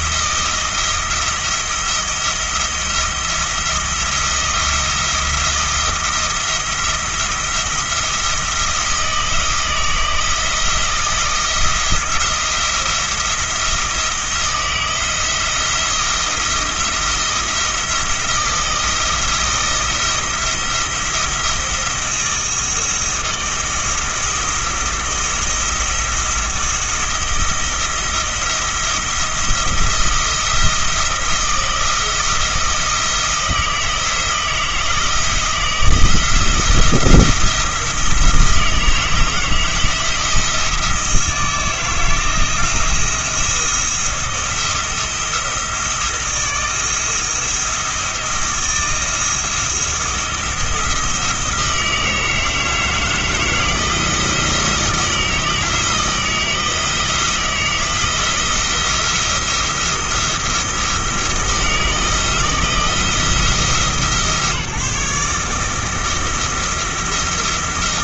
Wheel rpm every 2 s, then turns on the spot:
170, 170, 170, 170, 170, 160, 170, 170, 170, 170, 170, 170, 170, 160, 170, 170, 160, 160, 170, 160, 160, 170, 170, 170, 170, 160, 160, 160, 160, 170, 170, 170, 150, 170.
none